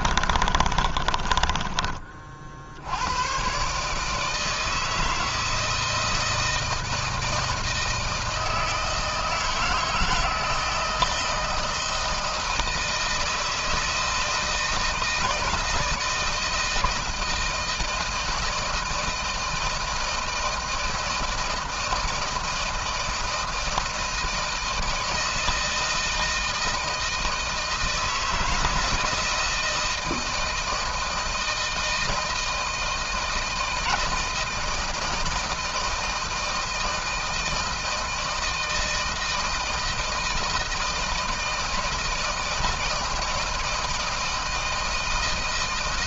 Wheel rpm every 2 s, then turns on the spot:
40, 80, 160, 160, 160, 160, 160, 170, 170, 160, 160, 160, 160, 160, 160, 160, 160, 160, 160, 160, 160, 160, 160.
0-2